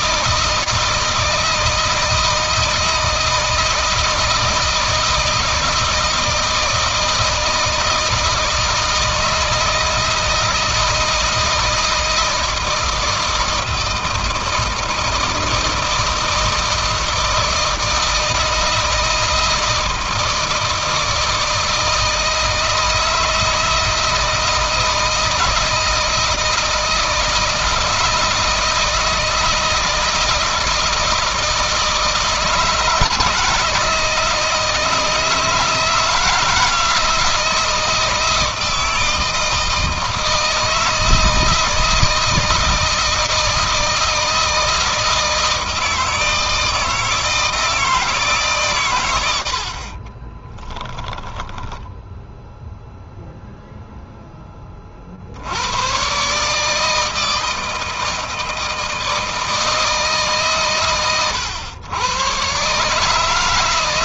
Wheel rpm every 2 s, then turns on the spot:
160, 160, 160, 160, 160, 160, 160, 160, 160, 160, 160, 160, 160, 160, 160, 160, 160, 160, 160, 160, 160, 160, 160, 160, 150, 30, 0, 10, 140, 160, 150, 120.
50-52